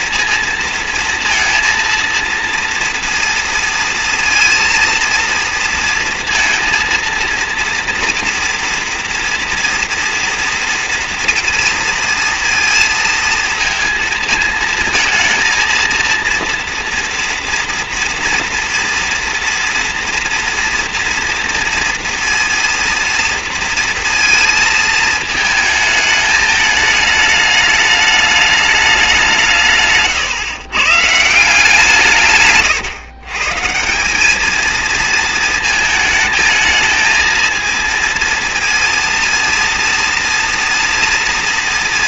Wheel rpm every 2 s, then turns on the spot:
230, 230, 230, 230, 230, 230, 230, 220, 230, 230, 230, 230, 230, 220, 210, 120, 140, 220, 220, 230, 230.
32-34